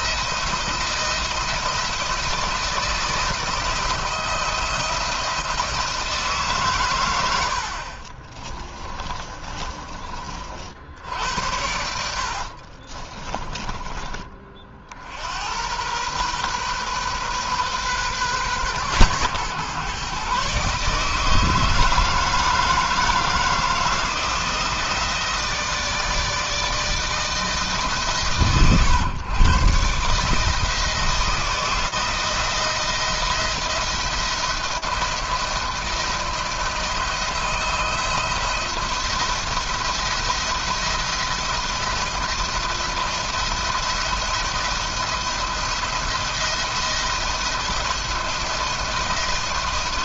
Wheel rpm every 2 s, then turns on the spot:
160, 160, 170, 100, 20, 70, 30, 60, 130, 130, 150, 160, 160, 160, 110, 160, 160, 170, 160, 170, 170, 170, 170, 170, 170.
8-10 12-14